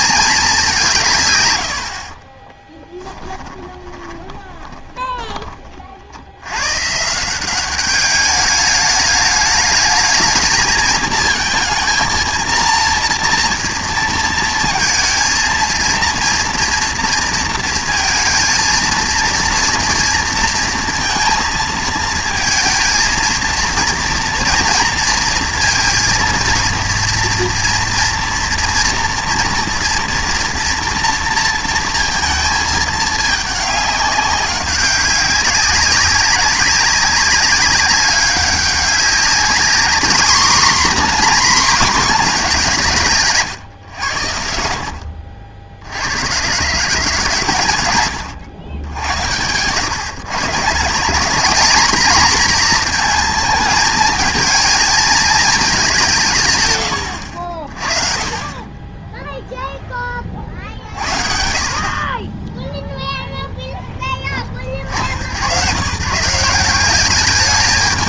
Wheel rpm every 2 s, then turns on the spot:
190, 10, 10, 120, 210, 220, 230, 220, 240, 230, 230, 230, 230, 230, 230, 230, 220, 190, 190, 200, 250, 190, 70, 140, 100, 160, 230, 220, 110, 20, 50, 10, 50, 190.
2-6 48-50